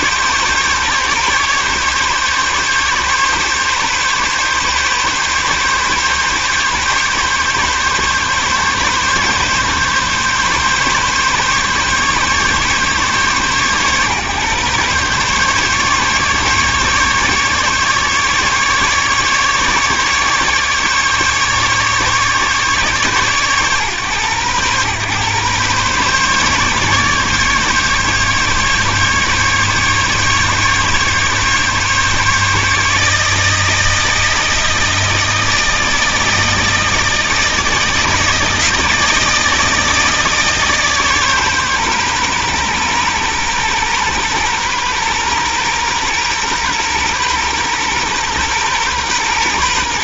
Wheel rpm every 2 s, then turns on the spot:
140, 140, 140, 140, 140, 140, 140, 130, 140, 150, 150, 140, 120, 140, 140, 140, 150, 160, 160, 160, 150, 120, 120, 120, 120.
none